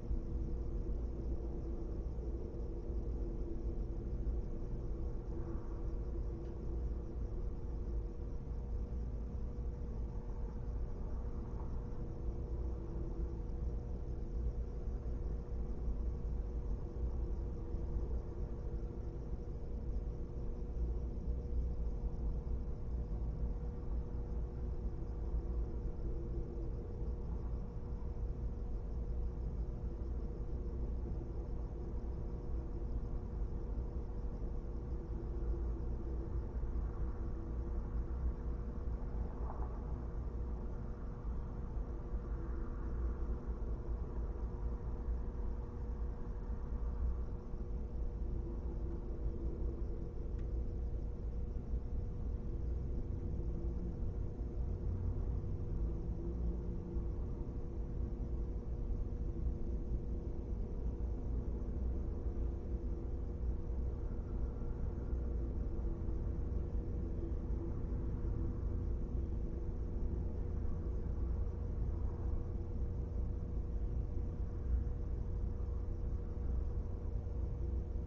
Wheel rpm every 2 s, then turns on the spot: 0, 0, 0, 0, 0, 0, 0, 0, 0, 0, 0, 0, 0, 0, 0, 0, 0, 0, 0, 0, 0, 0, 0, 0, 0, 0, 0, 0, 0, 0, 0, 0, 0, 0, 0, 0, 0, 0, 0.
none